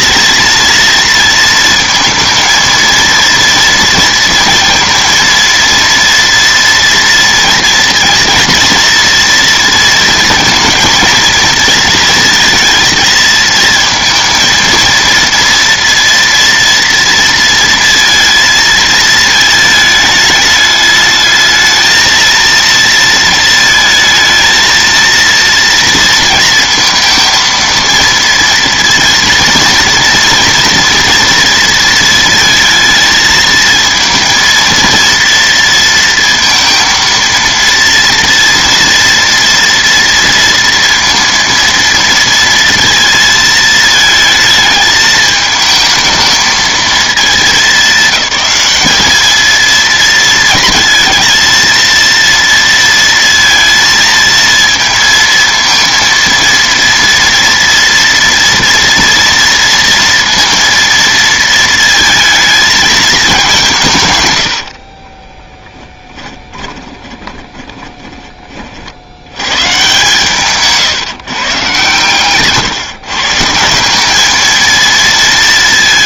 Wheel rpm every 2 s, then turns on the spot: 230, 230, 230, 230, 230, 220, 220, 230, 230, 220, 210, 230, 230, 230, 230, 240, 230, 230, 230, 230, 230, 230, 220, 220, 210, 230, 230, 230, 230, 230, 230, 220, 70, 20, 30, 140, 140, 220.
64-68 70-72